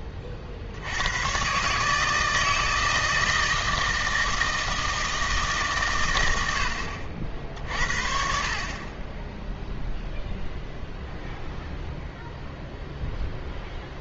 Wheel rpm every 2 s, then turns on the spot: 50, 160, 160, 100, 50, 0, 0.
none